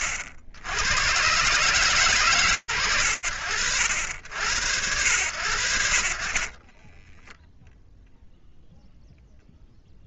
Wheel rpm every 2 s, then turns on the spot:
70, 110, 80, 20, 0.
6-8